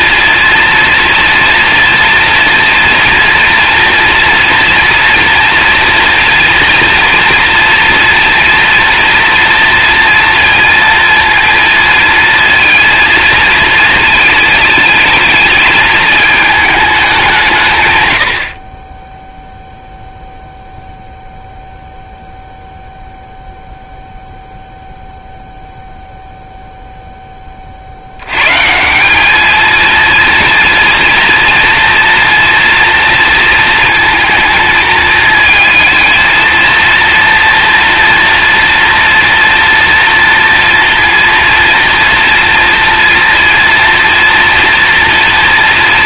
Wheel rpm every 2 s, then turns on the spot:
240, 240, 240, 230, 230, 230, 230, 220, 210, 30, 0, 0, 0, 0, 160, 230, 230, 220, 230, 230, 230, 230, 230.
none